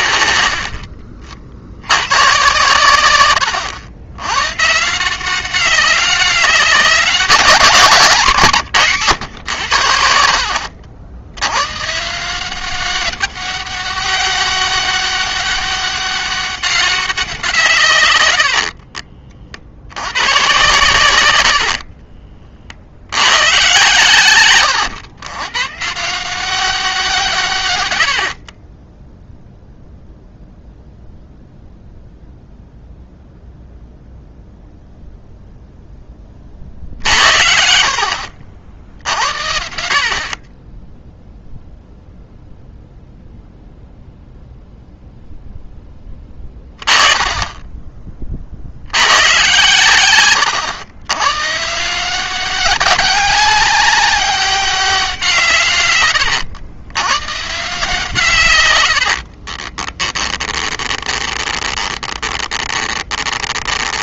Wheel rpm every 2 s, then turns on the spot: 50, 120, 170, 190, 140, 70, 200, 200, 190, 50, 110, 80, 110, 180, 10, 0, 0, 0, 50, 70, 0, 0, 0, 10, 90, 110, 190, 180, 110, 70, 20, 20.
0-2 18-20 58-64